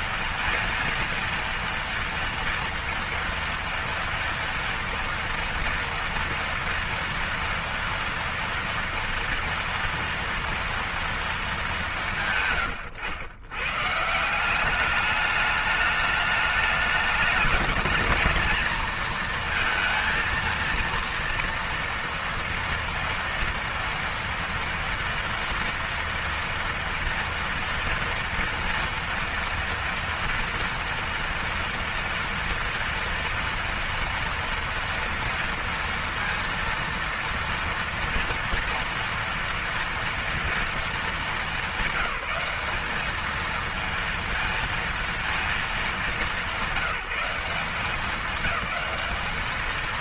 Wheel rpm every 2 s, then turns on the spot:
230, 230, 230, 230, 230, 230, 170, 150, 210, 220, 230, 230, 230, 230, 230, 240, 230, 230, 230, 230, 230, 200, 230, 200, 200.
none